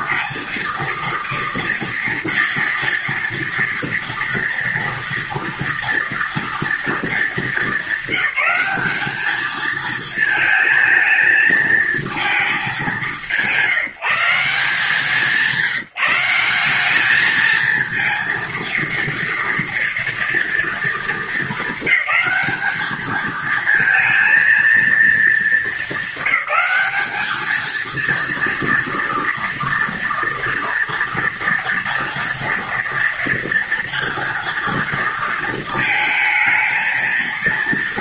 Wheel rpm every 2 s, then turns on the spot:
230, 230, 230, 230, 200, 220, 220, 170, 180, 230, 230, 220, 230, 220, 230, 230, 230, 230, 220.
none